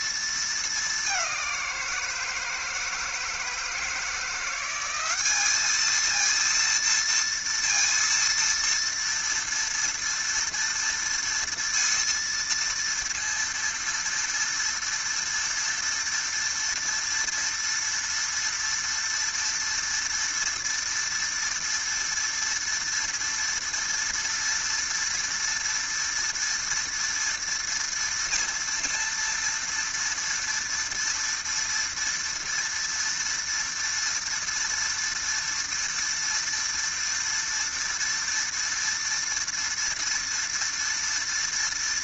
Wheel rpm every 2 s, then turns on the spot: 220, 160, 180, 230, 230, 230, 230, 230, 240, 230, 230, 230, 230, 230, 230, 230, 230, 230, 230, 230, 230.
none